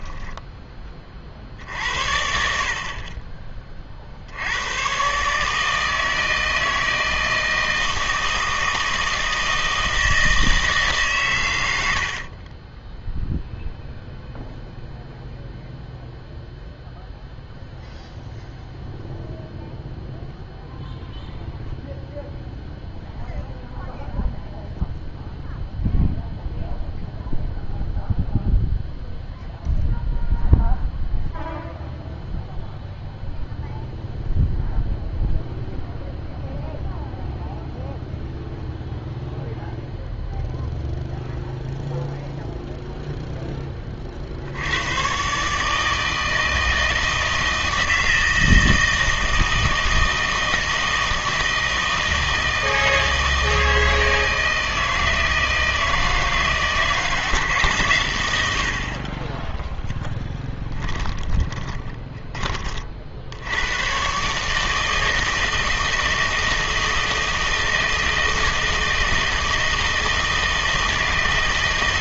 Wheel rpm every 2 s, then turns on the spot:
20, 50, 100, 160, 160, 150, 30, 0, 0, 0, 0, 0, 0, 0, 0, 0, 0, 0, 0, 0, 0, 0, 90, 160, 160, 160, 160, 160, 160, 70, 10, 30, 150, 160, 160, 160.
12-14 60-62